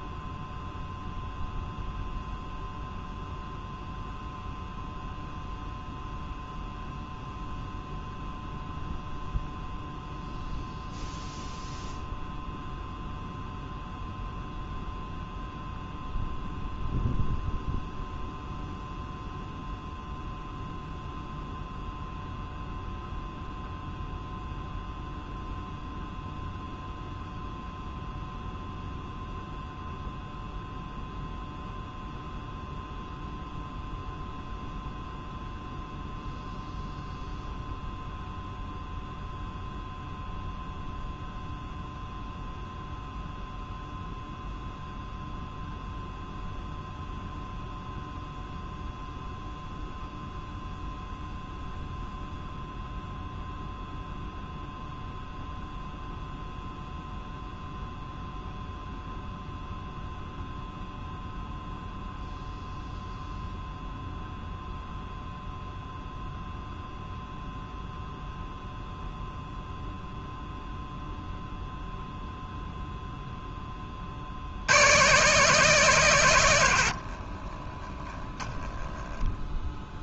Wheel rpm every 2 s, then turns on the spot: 0, 0, 0, 0, 0, 0, 0, 0, 0, 0, 0, 0, 0, 0, 0, 0, 0, 0, 0, 0, 0, 0, 0, 0, 0, 0, 0, 0, 0, 0, 0, 0, 0, 0, 0, 0, 0, 120, 40, 0.
76-78